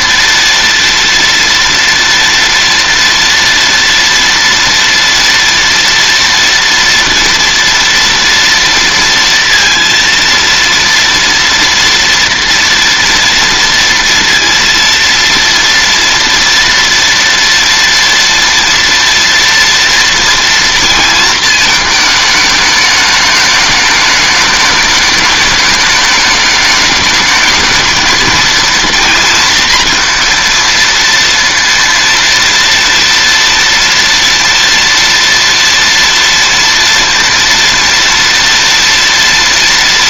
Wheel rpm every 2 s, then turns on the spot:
230, 230, 230, 240, 230, 230, 230, 230, 230, 240, 230, 210, 210, 210, 230, 230, 230, 230, 230, 230.
none